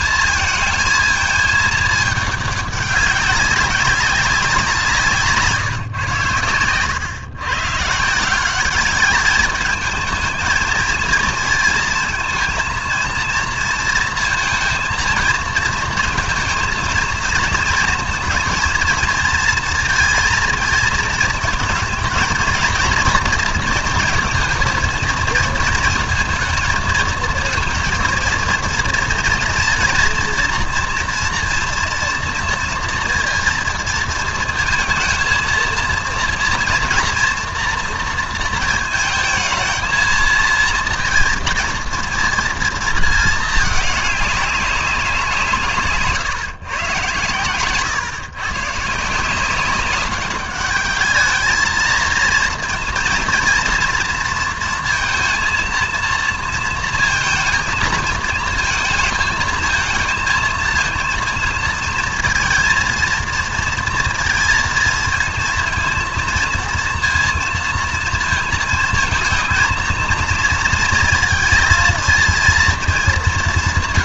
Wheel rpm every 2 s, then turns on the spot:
220, 200, 170, 100, 200, 220, 230, 230, 230, 230, 230, 230, 230, 230, 230, 230, 230, 220, 230, 230, 230, 230, 200, 140, 140, 210, 230, 230, 230, 230, 230, 230, 230, 230, 220, 230, 220.
none